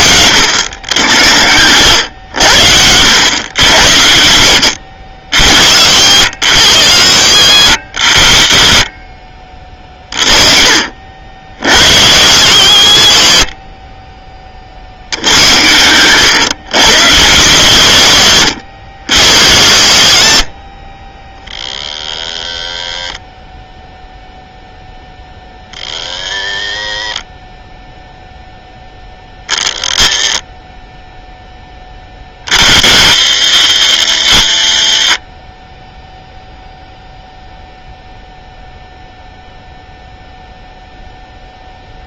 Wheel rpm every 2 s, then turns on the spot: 100, 100, 100, 130, 40, 70, 110, 90, 140, 120, 60, 40, 20, 60, 30, 10, 90, 40, 0, 0, 0.
8-10 20-22